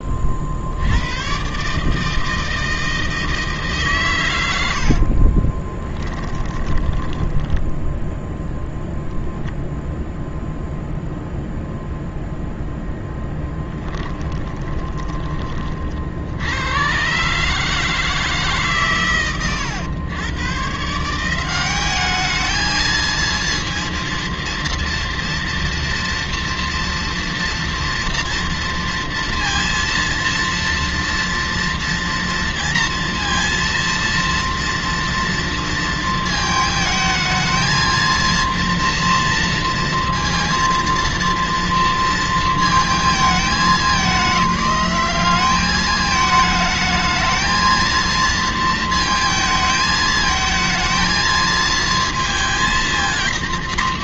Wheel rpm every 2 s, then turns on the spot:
80, 160, 80, 10, 0, 0, 0, 20, 100, 140, 150, 220, 230, 230, 230, 230, 230, 230, 220, 230, 230, 220, 200, 220, 220, 220, 230.
4-8 14-16